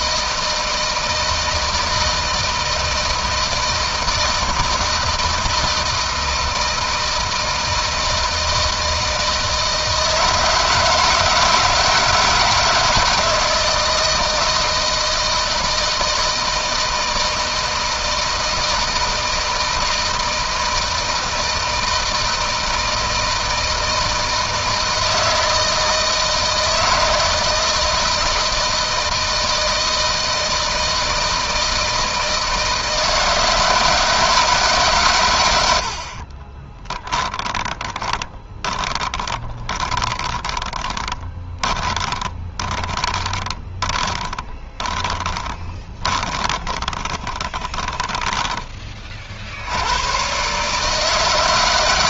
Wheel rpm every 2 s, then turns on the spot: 160, 160, 160, 160, 160, 160, 160, 160, 160, 160, 160, 160, 160, 160, 160, 160, 160, 150, 30, 20, 10, 20, 20, 20, 20, 130.
36-48